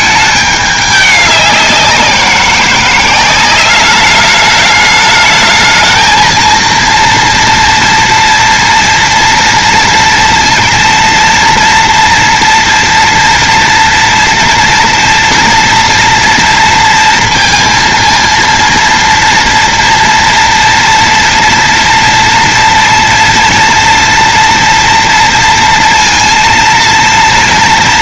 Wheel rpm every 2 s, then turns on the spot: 200, 190, 210, 230, 230, 230, 240, 240, 230, 230, 230, 230, 230, 230.
none